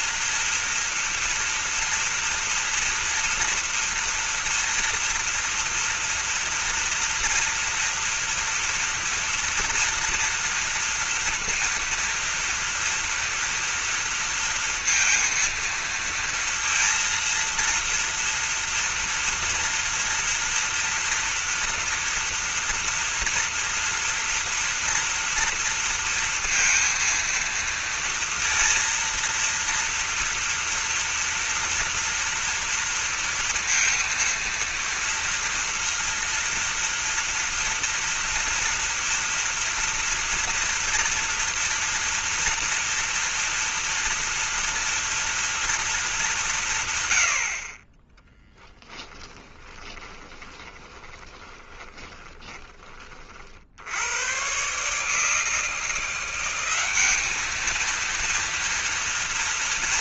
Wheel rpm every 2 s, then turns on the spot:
240, 230, 230, 240, 230, 230, 230, 230, 230, 230, 230, 230, 230, 230, 230, 230, 230, 230, 230, 230, 230, 230, 230, 160, 10, 20, 20, 130, 190, 230.
48-54